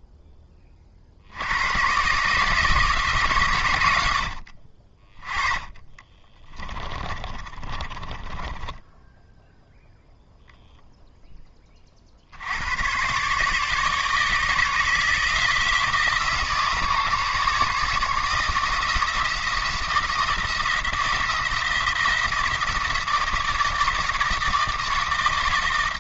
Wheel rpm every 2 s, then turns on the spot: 20, 160, 40, 20, 10, 0, 100, 160, 150, 160, 160, 160, 160.
6-10